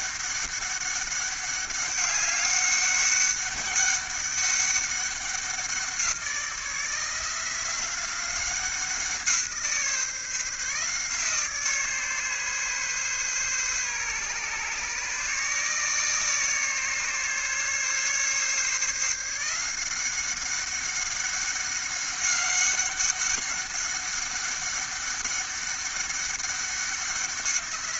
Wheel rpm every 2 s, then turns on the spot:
200, 200, 190, 170, 180, 150, 140, 150, 150, 150, 190, 200, 200, 190.
none